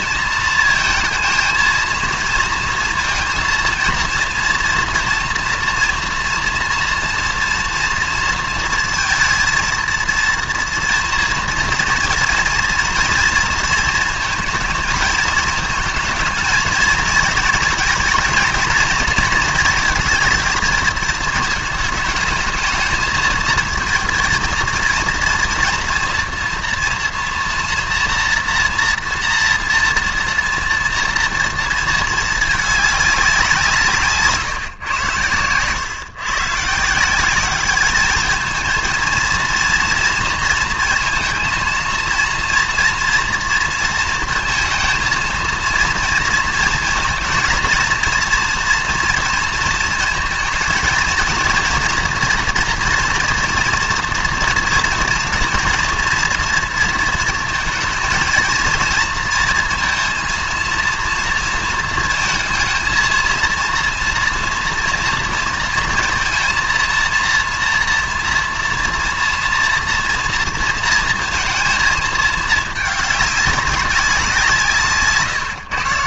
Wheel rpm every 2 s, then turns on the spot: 220, 230, 230, 240, 230, 230, 230, 220, 220, 230, 220, 220, 230, 230, 240, 230, 210, 130, 150, 220, 220, 230, 230, 230, 240, 230, 230, 240, 230, 230, 230, 230, 230, 230, 240, 230, 210, 170.
none